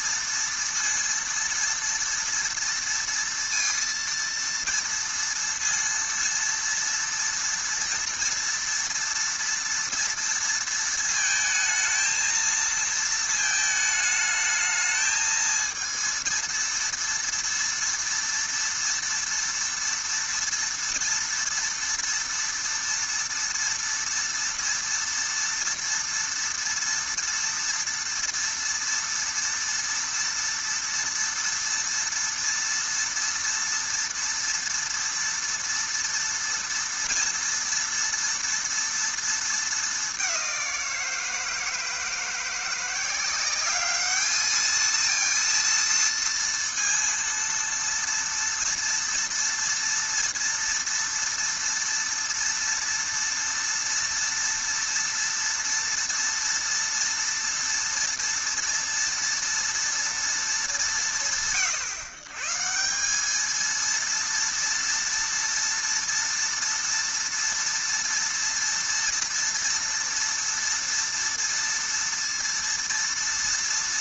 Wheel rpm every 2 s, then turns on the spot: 230, 230, 230, 230, 230, 230, 230, 220, 230, 230, 230, 230, 230, 230, 230, 230, 230, 230, 230, 230, 180, 170, 220, 230, 240, 230, 230, 230, 230, 230, 200, 160, 230, 230, 230, 230, 230.
none